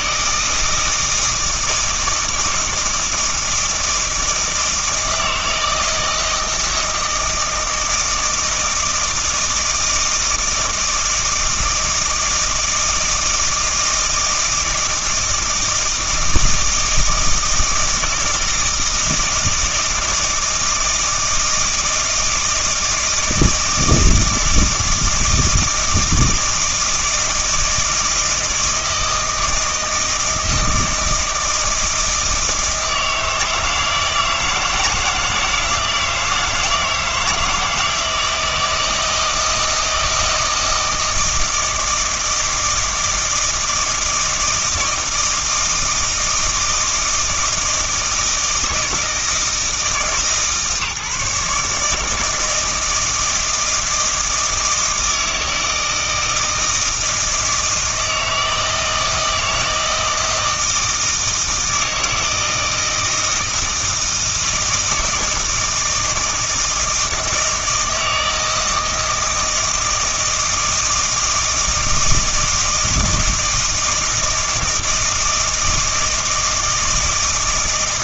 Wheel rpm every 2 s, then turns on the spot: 160, 160, 160, 160, 160, 160, 160, 160, 160, 160, 160, 160, 160, 160, 160, 160, 160, 170, 160, 160, 160, 160, 160, 160, 160, 150, 160, 160, 160, 160, 160, 160, 160, 160, 160, 160, 160, 160, 160.
none